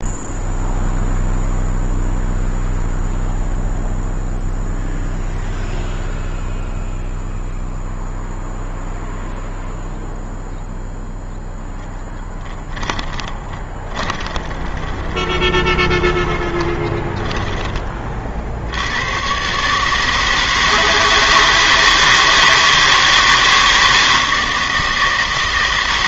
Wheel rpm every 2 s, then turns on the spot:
0, 0, 0, 0, 0, 0, 10, 20, 20, 60, 160, 160, 160.
12-18